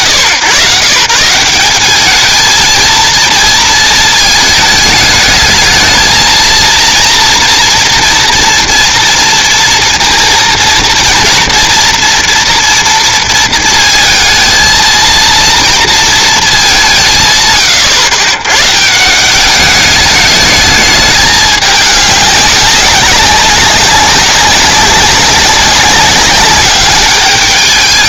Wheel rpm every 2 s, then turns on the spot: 140, 220, 220, 230, 230, 230, 230, 220, 200, 130, 210, 190, 190, 200.
none